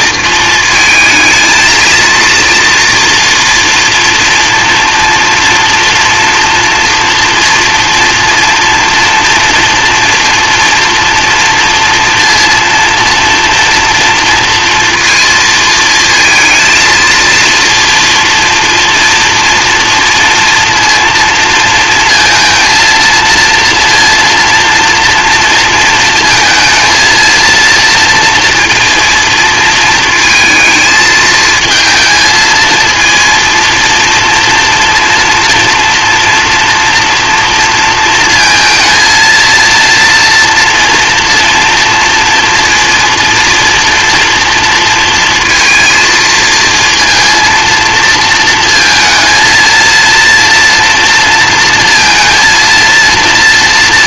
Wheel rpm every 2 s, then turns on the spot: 220, 230, 240, 230, 230, 240, 230, 230, 230, 230, 230, 230, 230, 230, 230, 220, 220, 230, 230, 230, 240, 230, 230, 230, 230, 230, 230.
none